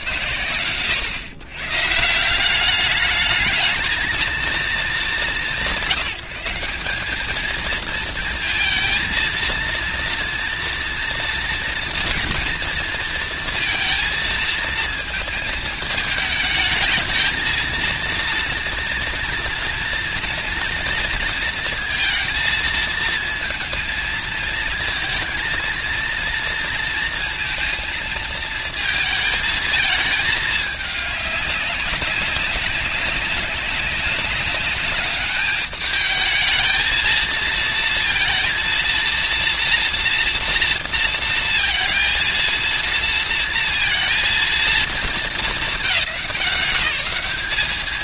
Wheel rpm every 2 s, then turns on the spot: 120, 200, 200, 180, 220, 230, 230, 220, 220, 230, 230, 230, 230, 230, 220, 210, 200, 200, 220, 230, 230, 230, 220, 180.
none